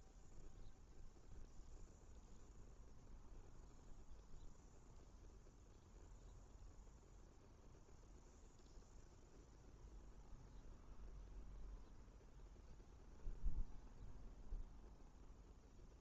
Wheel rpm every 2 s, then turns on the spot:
0, 0, 0, 0, 0, 0, 0, 0.
none